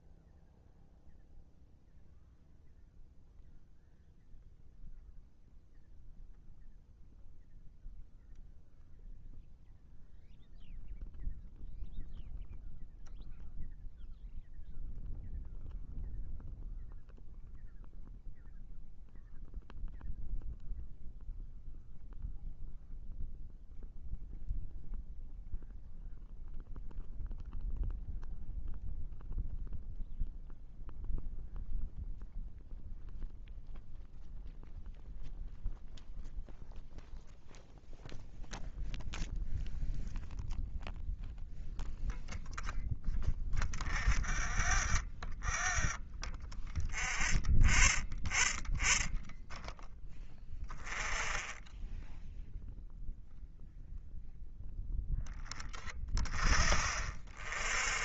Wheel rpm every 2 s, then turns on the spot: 0, 0, 0, 0, 0, 0, 0, 0, 0, 0, 0, 0, 0, 0, 0, 0, 0, 0, 0, 0, 0, 0, 0, 0, 0, 0, 0, 0, 0.
none